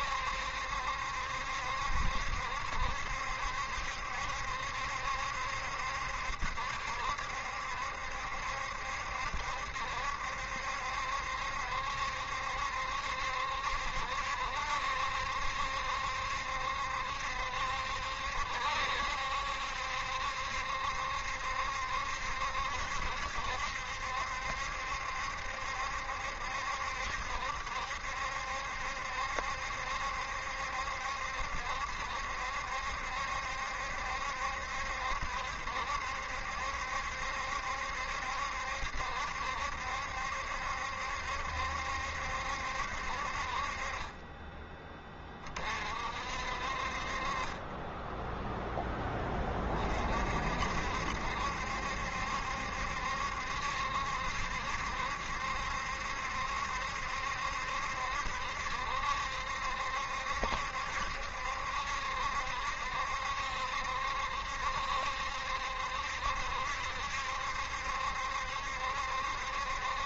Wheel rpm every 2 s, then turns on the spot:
70, 70, 70, 70, 70, 70, 70, 70, 70, 70, 70, 70, 70, 70, 70, 70, 70, 70, 70, 70, 70, 60, 10, 50, 10, 60, 70, 70, 70, 70, 70, 70, 70, 70, 70.
none